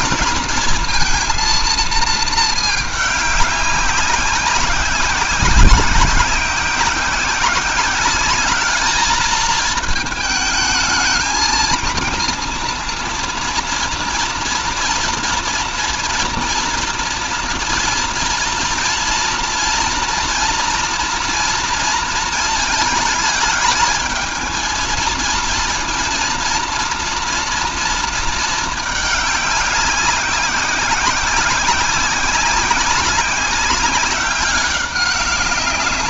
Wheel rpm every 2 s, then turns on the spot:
220, 210, 190, 180, 210, 220, 230, 230, 230, 230, 230, 220, 220, 230, 220, 190, 190, 200.
none